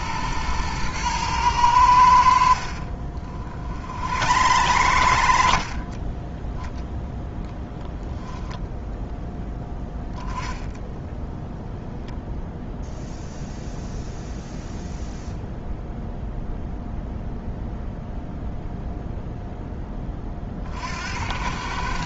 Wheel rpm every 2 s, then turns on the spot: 110, 50, 110, 10, 10, 20, 0, 0, 0, 0, 50.
2-8 10-12